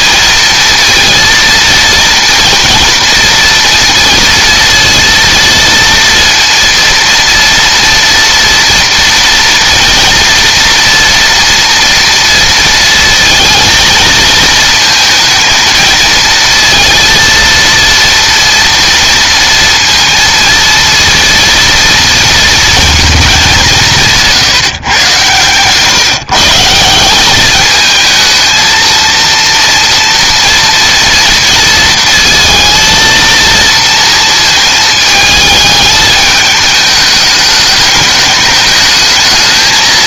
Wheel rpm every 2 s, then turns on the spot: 230, 230, 230, 230, 230, 230, 230, 230, 230, 230, 230, 230, 150, 160, 220, 230, 220, 220, 220, 210.
none